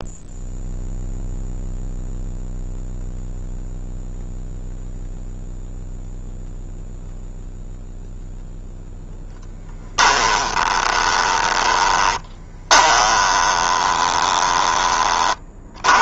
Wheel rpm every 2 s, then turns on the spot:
0, 0, 0, 0, 0, 20, 20, 20.
10-14